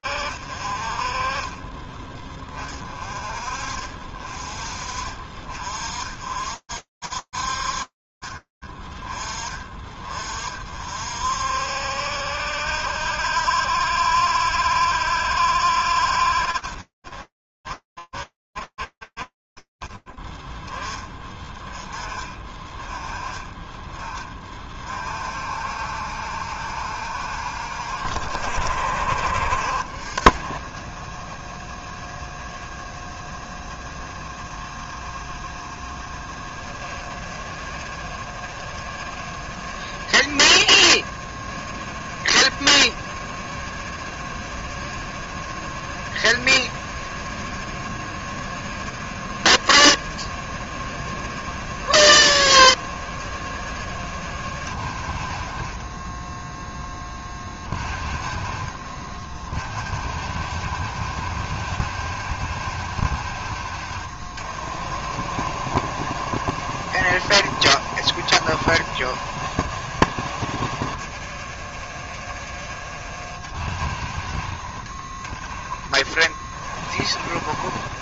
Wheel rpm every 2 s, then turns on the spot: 50, 30, 20, 50, 30, 60, 70, 70, 20, 30, 30, 70, 60, 50, 30, 40, 40, 40, 40, 40, 40, 40, 40, 40, 40, 40, 40, 10, 30, 50, 50, 40, 50, 50, 40, 40, 30, 30, 40.
none